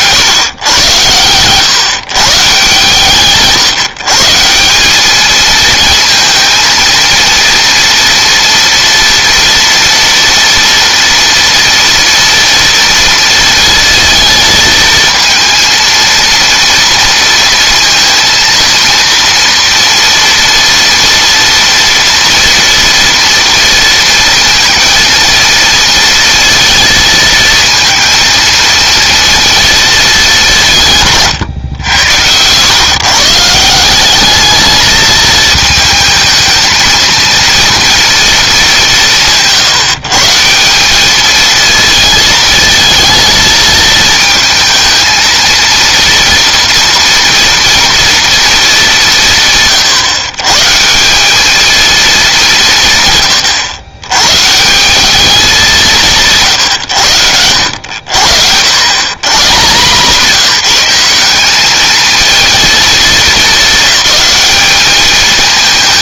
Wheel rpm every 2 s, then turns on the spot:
120, 150, 190, 230, 230, 230, 230, 220, 230, 230, 230, 230, 230, 230, 230, 150, 130, 220, 230, 190, 200, 220, 220, 240, 210, 170, 150, 180, 110, 120, 180, 220, 210.
none